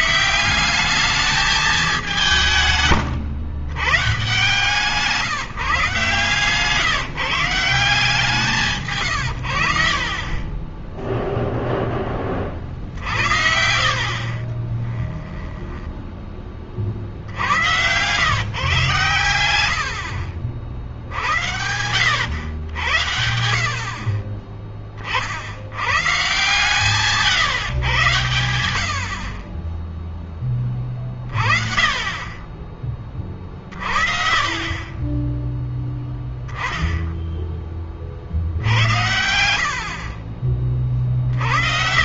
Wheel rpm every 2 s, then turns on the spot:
180, 160, 150, 160, 150, 10, 40, 30, 40, 130, 60, 90, 40, 130, 90, 20, 30, 30, 0, 70, 40.
2-4 8-10 14-16 20-22